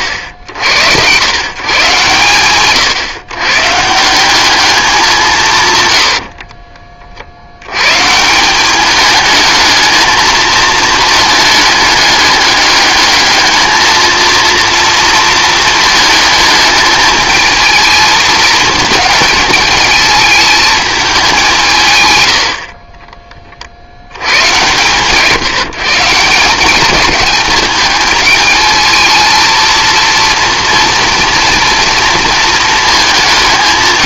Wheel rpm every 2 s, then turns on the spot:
80, 130, 200, 30, 190, 220, 210, 230, 210, 220, 220, 60, 130, 190, 220, 230, 220.
none